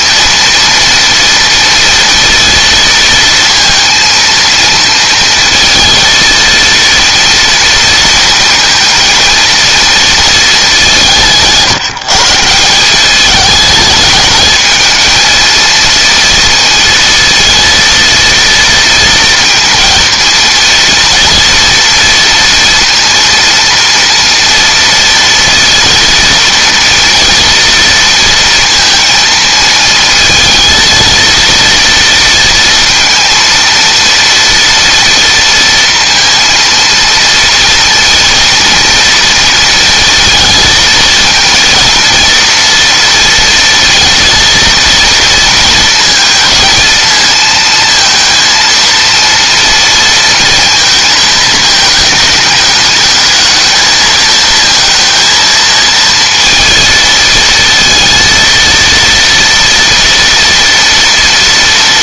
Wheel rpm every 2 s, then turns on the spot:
230, 230, 230, 230, 230, 180, 190, 220, 230, 230, 230, 230, 230, 230, 230, 230, 230, 230, 230, 230, 220, 230, 230, 220, 230, 230, 210, 230, 220, 230, 230.
none